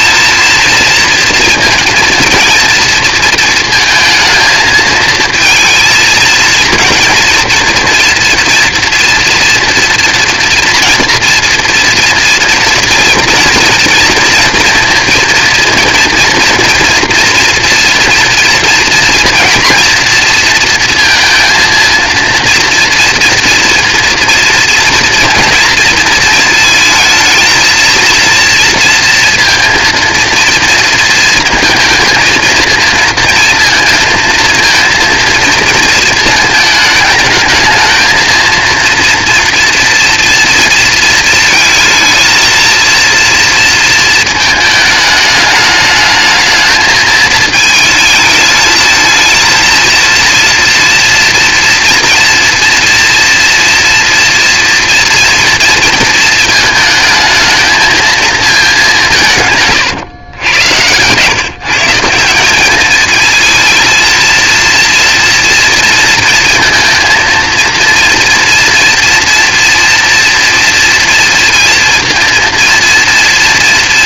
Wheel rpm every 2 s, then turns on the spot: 230, 230, 220, 220, 240, 230, 230, 230, 230, 230, 230, 240, 230, 220, 230, 230, 230, 230, 220, 230, 230, 230, 220, 220, 220, 230, 230, 230, 220, 210, 110, 200, 230, 230, 240, 230, 230.
none